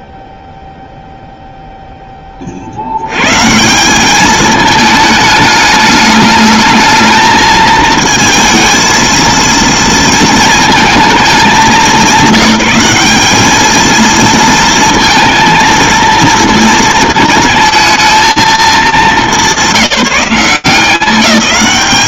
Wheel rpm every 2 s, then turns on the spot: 0, 50, 220, 220, 220, 230, 200, 230, 220, 210, 190.
none